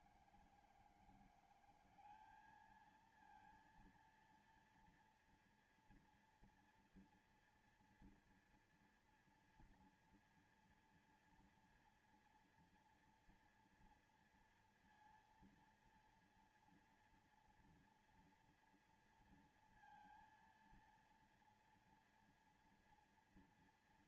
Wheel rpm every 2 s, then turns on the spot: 160, 210, 230, 230, 230, 230, 230, 230, 240, 230, 230, 240.
none